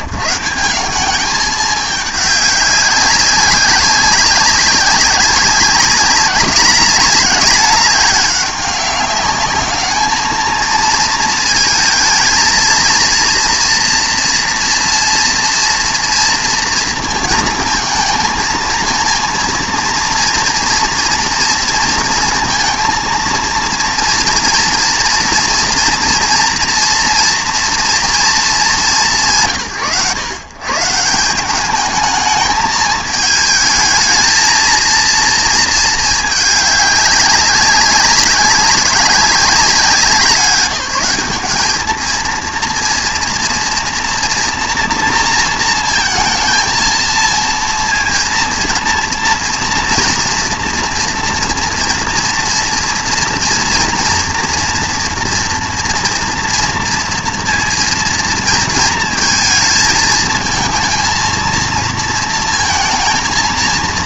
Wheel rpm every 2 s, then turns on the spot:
140, 200, 200, 200, 200, 230, 230, 240, 230, 230, 240, 230, 230, 230, 230, 140, 220, 230, 200, 190, 190, 240, 240, 230, 230, 230, 230, 230, 230, 230, 220, 230.
none